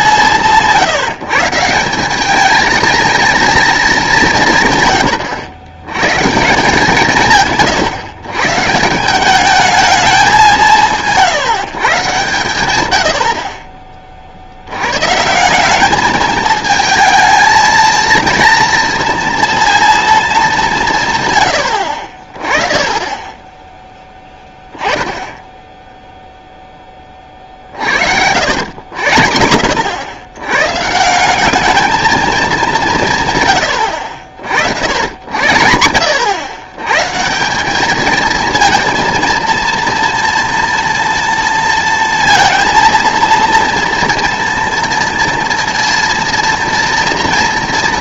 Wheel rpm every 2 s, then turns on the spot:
170, 220, 140, 160, 140, 170, 110, 80, 220, 230, 200, 20, 10, 0, 90, 130, 200, 70, 110, 230, 230, 230, 230, 230.
none